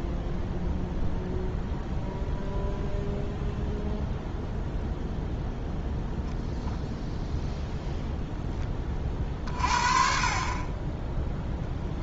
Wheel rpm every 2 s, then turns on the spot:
0, 0, 0, 0, 20, 20.
none